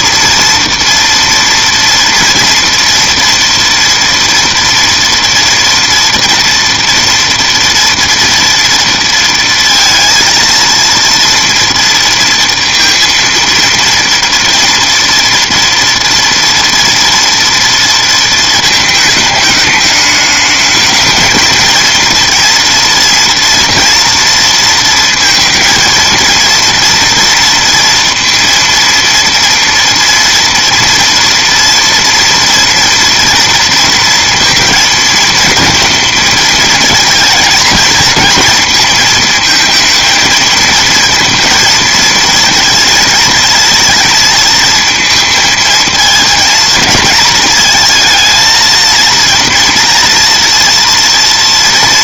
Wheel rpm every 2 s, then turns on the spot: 230, 230, 230, 240, 230, 230, 230, 230, 230, 220, 210, 240, 230, 230, 230, 230, 230, 230, 220, 220, 230, 230, 220, 230, 230, 230.
none